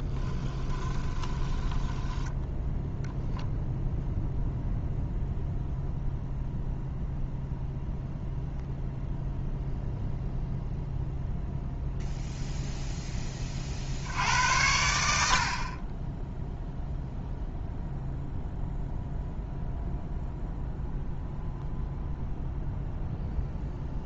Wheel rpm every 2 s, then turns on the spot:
10, 0, 0, 0, 0, 0, 10, 70, 0, 0, 0, 0.
0-2